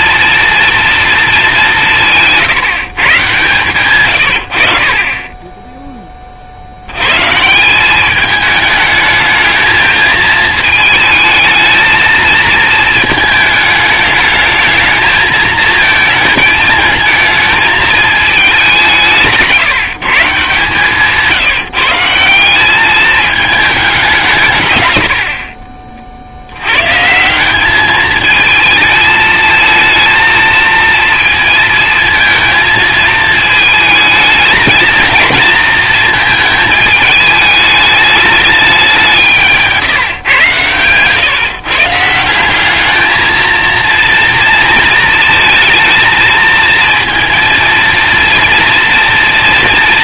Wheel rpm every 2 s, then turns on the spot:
230, 150, 70, 60, 210, 220, 230, 210, 220, 200, 150, 190, 130, 90, 220, 230, 230, 220, 220, 210, 120, 190, 230, 220, 230.
none